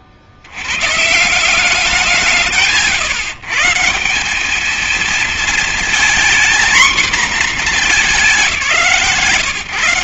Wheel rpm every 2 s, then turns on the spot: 80, 150, 220, 240, 180.
none